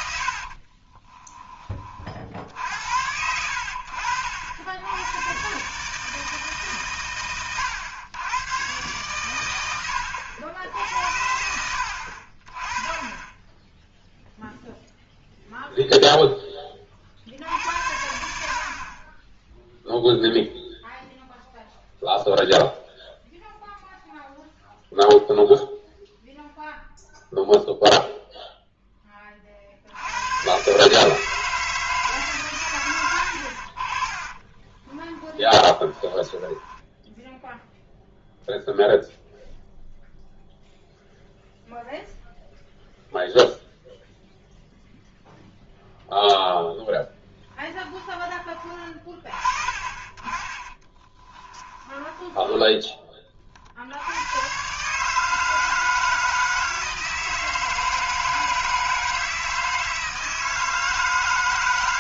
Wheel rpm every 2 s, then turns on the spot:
50, 60, 80, 140, 120, 80, 20, 0, 30, 50, 0, 0, 0, 0, 0, 130, 120, 20, 10, 0, 0, 0, 0, 0, 20, 30, 10, 130, 160, 160, 160.
0-2 34-38 50-52